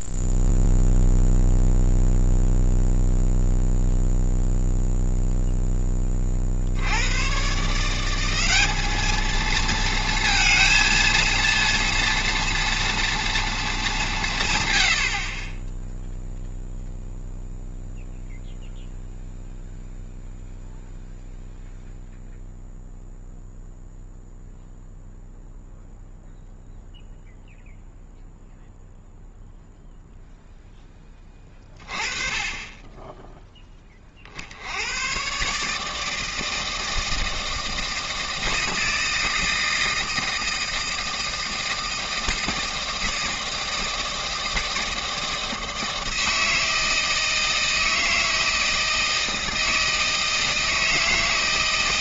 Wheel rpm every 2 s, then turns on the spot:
0, 0, 0, 60, 200, 230, 230, 120, 0, 0, 0, 0, 0, 0, 0, 0, 20, 70, 160, 160, 160, 160, 160, 160, 160, 160.
none